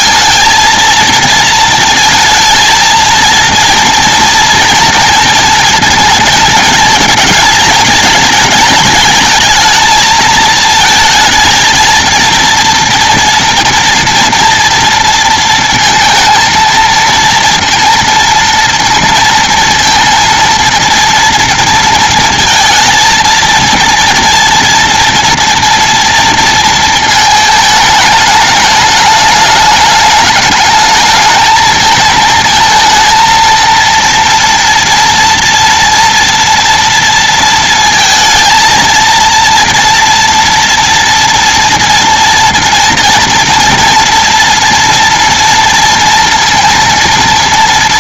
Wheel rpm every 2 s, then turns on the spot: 230, 220, 230, 220, 220, 220, 230, 230, 230, 230, 230, 230, 230, 230, 210, 210, 220, 230, 230, 230, 240, 230, 230, 240.
none